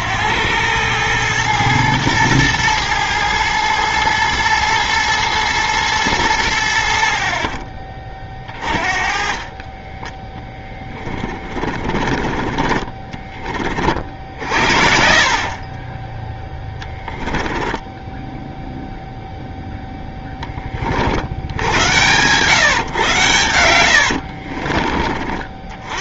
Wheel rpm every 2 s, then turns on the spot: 100, 110, 110, 70, 30, 20, 30, 50, 10, 0, 30, 120, 50.
8-14 16-18 24-26